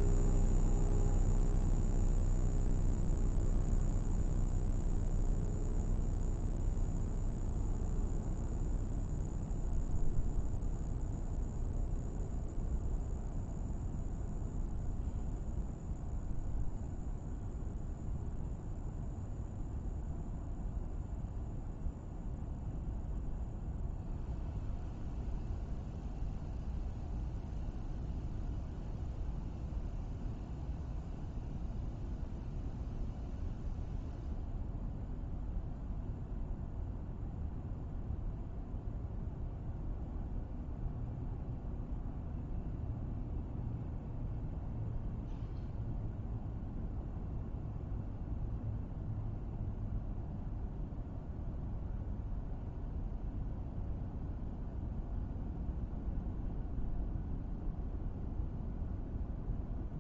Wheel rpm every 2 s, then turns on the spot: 0, 0, 0, 0, 0, 0, 0, 0, 0, 0, 0, 0, 0, 0, 0, 0, 0, 0, 0, 0, 0, 0, 0, 0, 0, 0, 0, 0, 0, 0.
none